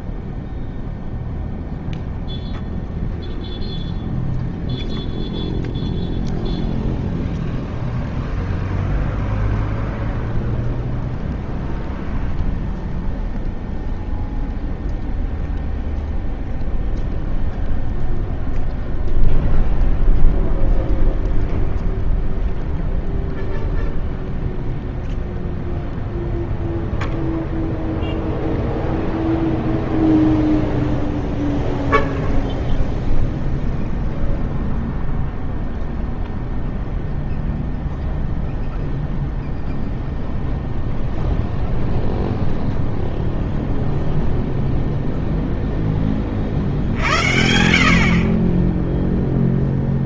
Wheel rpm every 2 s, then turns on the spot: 0, 0, 0, 0, 0, 0, 0, 0, 0, 0, 0, 0, 0, 0, 0, 0, 0, 0, 0, 0, 0, 0, 0, 70, 10.
none